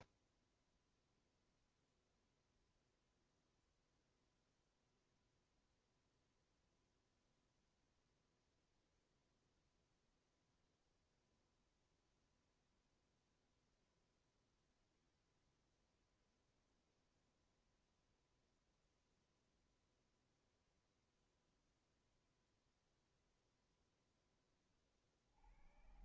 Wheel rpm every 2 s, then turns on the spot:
0, 0, 0, 0, 0, 0, 0, 0, 0, 0, 0, 0, 20.
none